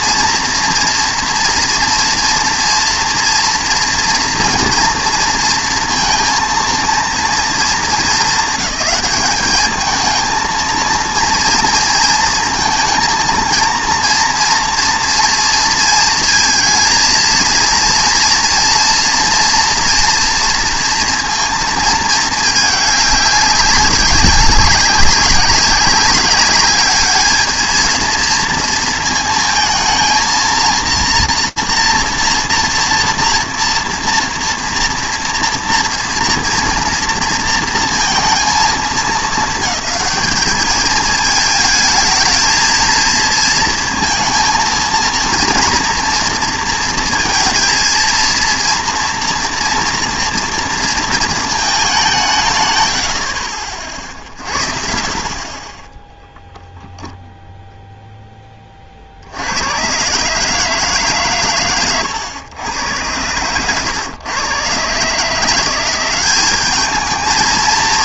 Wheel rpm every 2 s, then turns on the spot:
230, 230, 230, 230, 220, 230, 230, 230, 220, 230, 230, 210, 200, 200, 230, 230, 230, 230, 230, 220, 220, 220, 230, 230, 230, 230, 110, 50, 0, 20, 150, 110, 120, 200.
none